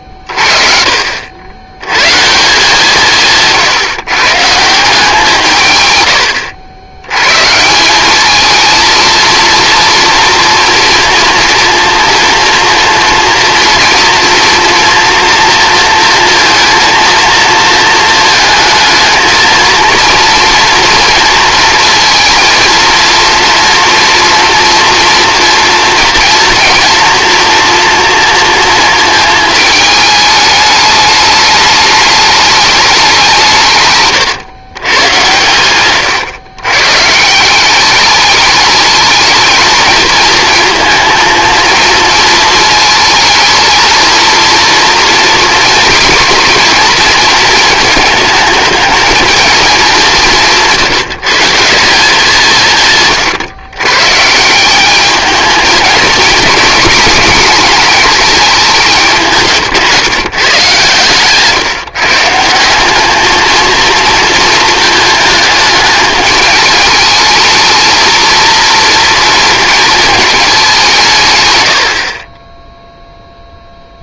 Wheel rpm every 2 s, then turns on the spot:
50, 160, 160, 80, 220, 240, 230, 230, 230, 220, 230, 230, 230, 230, 230, 210, 210, 110, 120, 210, 230, 220, 230, 240, 220, 170, 170, 190, 230, 200, 130, 180, 220, 210, 230, 210, 20.
none